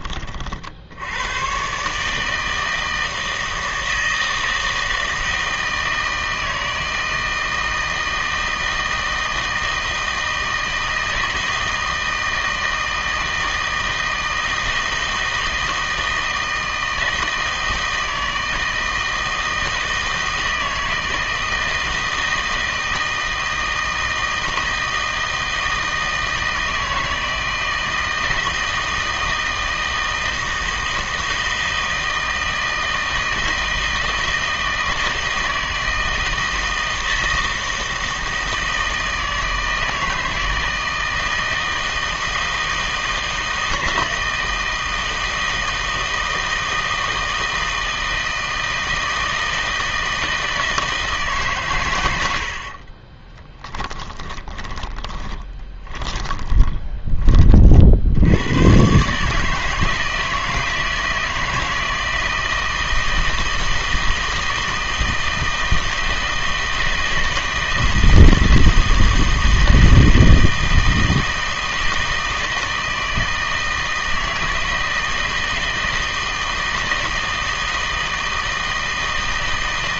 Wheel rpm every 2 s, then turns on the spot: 60, 160, 160, 160, 160, 160, 160, 160, 160, 160, 160, 160, 160, 160, 160, 160, 160, 160, 160, 160, 160, 160, 160, 160, 160, 160, 60, 30, 20, 120, 160, 160, 160, 160, 160, 160, 160, 160, 160, 160.
52-58